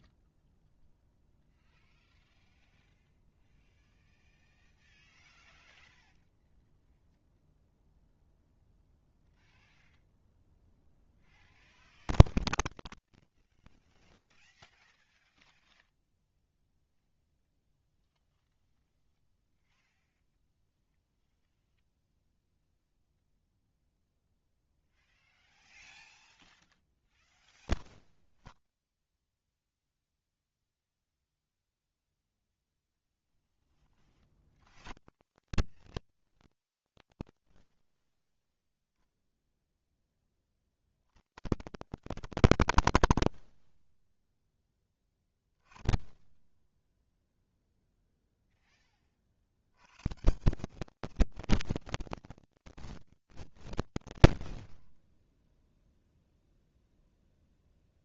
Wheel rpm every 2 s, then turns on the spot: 0, 0, 0, 0, 0, 0, 0, 0, 0, 0, 0, 0, 0, 0, 0, 0, 0, 0, 0, 0, 0, 0, 10, 10, 0, 190, 220, 60, 0.
54-56